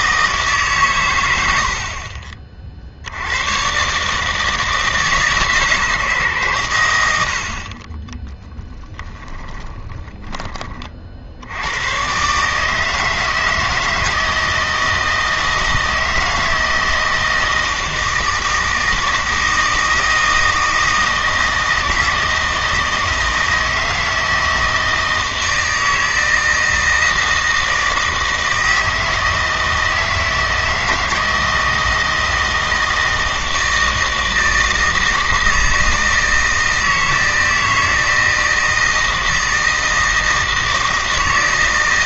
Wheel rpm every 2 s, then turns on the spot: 130, 60, 160, 110, 20, 40, 150, 160, 160, 160, 160, 160, 160, 160, 160, 160, 160, 160, 160, 160, 160.
8-10